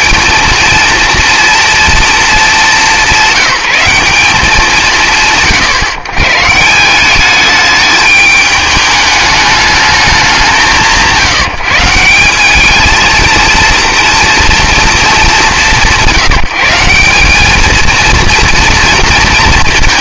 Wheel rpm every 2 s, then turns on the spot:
230, 180, 160, 130, 210, 190, 200, 230, 190, 230.
none